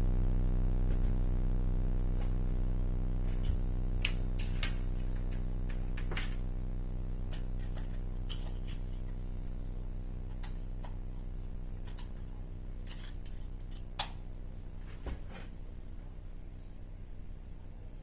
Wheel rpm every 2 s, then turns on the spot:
0, 0, 0, 0, 0, 0, 0, 0, 0.
none